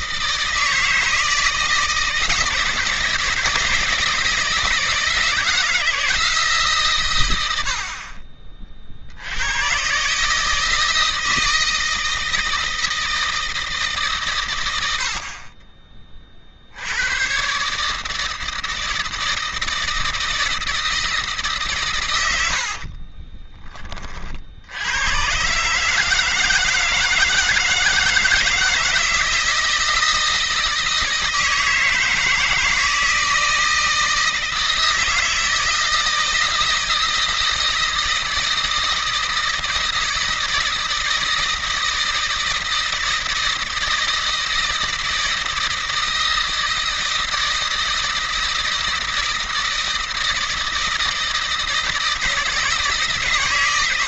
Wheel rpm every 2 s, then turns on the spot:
160, 170, 160, 150, 40, 150, 160, 100, 60, 160, 160, 60, 80, 160, 160, 160, 160, 160, 160, 160, 160, 160, 160, 160, 160, 160, 160.
22-24